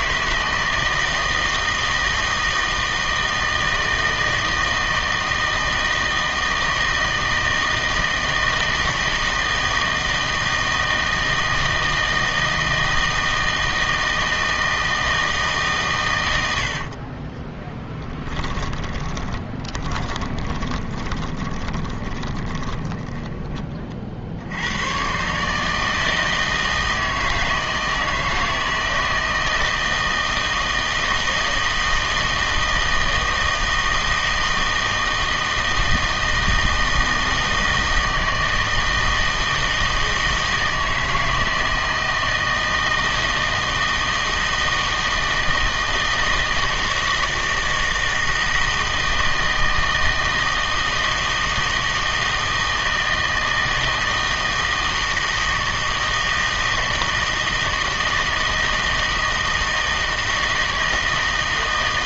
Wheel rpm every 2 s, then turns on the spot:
160, 160, 160, 160, 160, 160, 160, 160, 70, 20, 20, 10, 90, 160, 160, 160, 160, 160, 160, 160, 160, 160, 160, 160, 160, 160, 160, 160, 160, 160, 160.
16-24